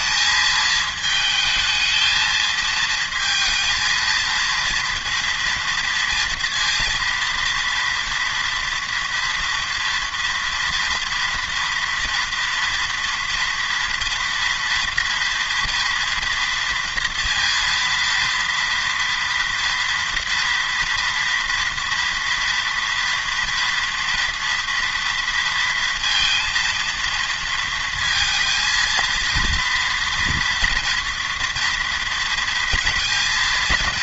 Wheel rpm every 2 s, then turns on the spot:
220, 220, 230, 230, 230, 230, 230, 230, 230, 230, 230, 230, 230, 230, 230, 230, 230.
none